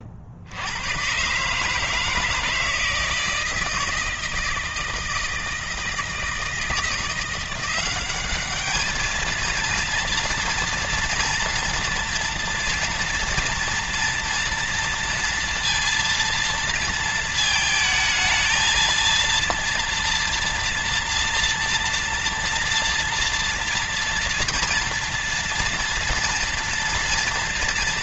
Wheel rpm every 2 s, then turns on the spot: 70, 160, 160, 170, 210, 230, 230, 230, 230, 220, 230, 230, 230, 230.
none